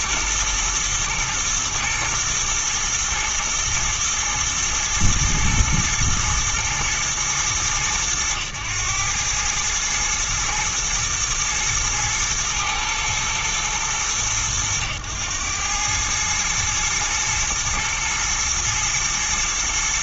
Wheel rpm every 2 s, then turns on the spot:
110, 110, 120, 120, 110, 110, 110, 100, 110, 110.
none